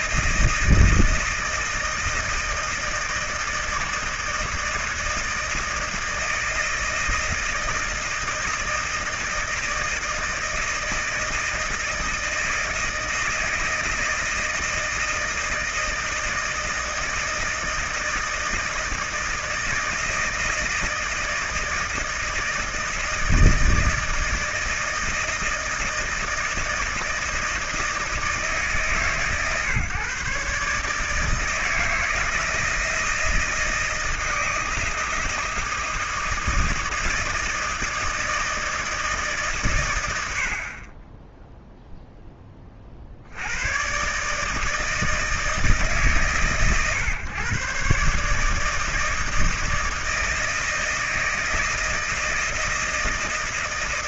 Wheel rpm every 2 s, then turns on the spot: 160, 160, 160, 160, 160, 160, 160, 160, 160, 160, 160, 160, 160, 160, 150, 140, 160, 160, 160, 160, 80, 20, 150, 130, 150, 160, 160.
none